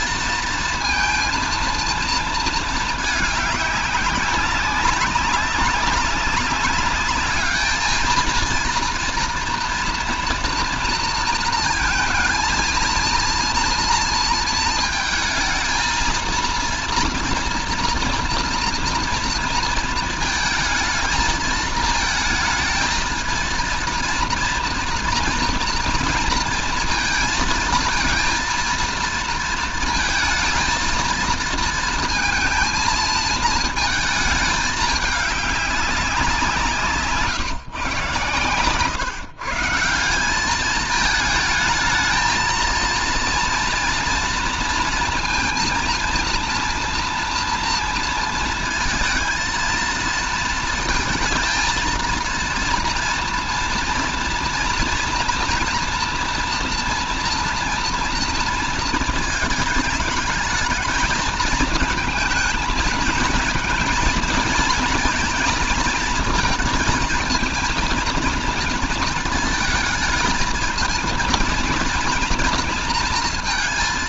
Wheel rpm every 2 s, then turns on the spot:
230, 220, 200, 200, 230, 230, 230, 230, 230, 230, 220, 220, 230, 230, 230, 230, 230, 210, 150, 130, 210, 230, 230, 240, 230, 230, 230, 230, 230, 230, 220, 220, 230, 220, 230, 220, 230.
none